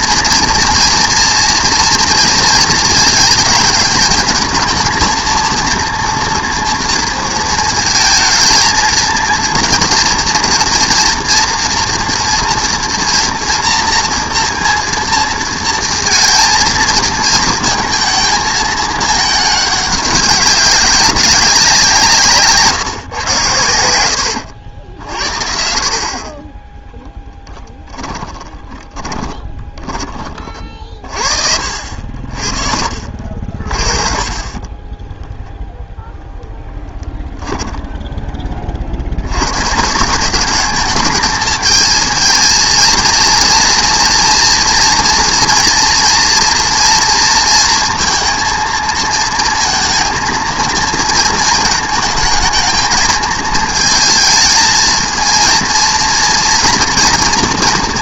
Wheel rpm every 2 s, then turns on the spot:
230, 230, 220, 230, 230, 230, 230, 230, 230, 220, 200, 150, 90, 10, 10, 30, 50, 30, 0, 20, 200, 220, 230, 230, 230, 230, 220, 220, 230.
22-24 28-30